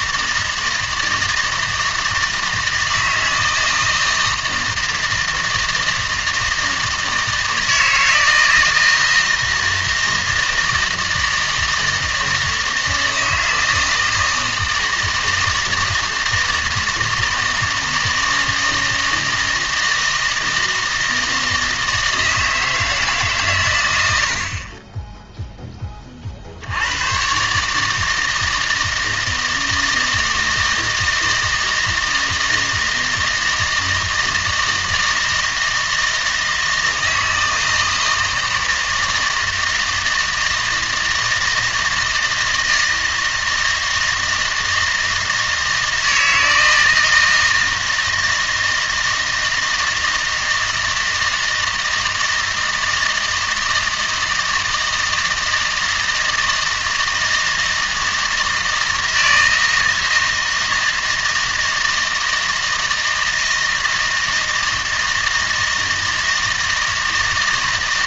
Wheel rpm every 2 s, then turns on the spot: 160, 160, 160, 160, 160, 160, 160, 160, 160, 160, 160, 160, 50, 60, 160, 160, 160, 160, 160, 160, 160, 160, 160, 160, 160, 160, 160, 160, 160, 160, 160, 160, 160, 160.
none